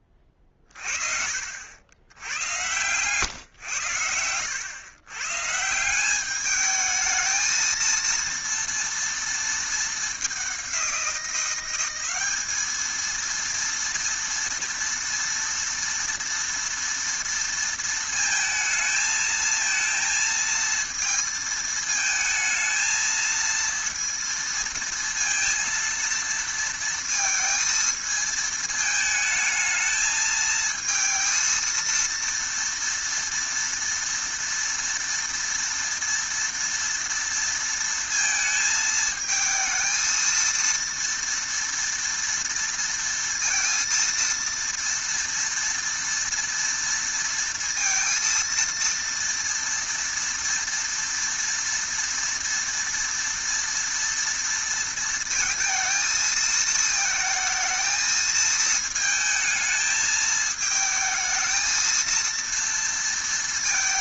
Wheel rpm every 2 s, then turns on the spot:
40, 110, 110, 210, 230, 190, 220, 230, 230, 230, 230, 220, 230, 230, 220, 220, 230, 230, 230, 220, 230, 230, 230, 230, 230, 230, 230, 230, 220, 220, 220, 230.
none